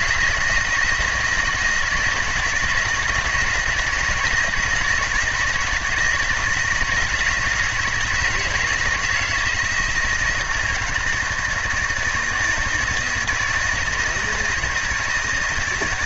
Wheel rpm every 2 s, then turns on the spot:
170, 170, 170, 170, 160, 160, 160, 160.
none